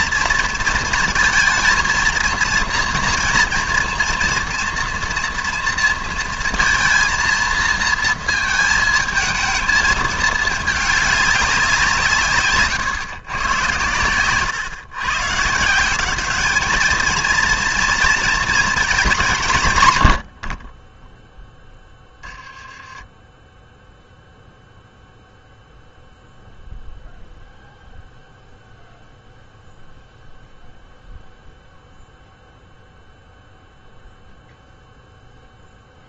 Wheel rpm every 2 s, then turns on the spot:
220, 230, 230, 230, 220, 210, 130, 120, 210, 230, 40, 10, 0, 0, 0, 0, 0, 0.
none